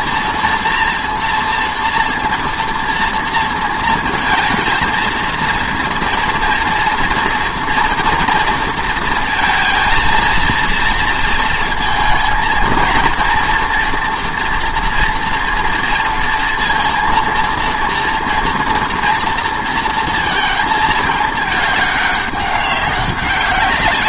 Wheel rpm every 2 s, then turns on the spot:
230, 230, 220, 230, 230, 230, 230, 230, 230, 240, 230, 200.
none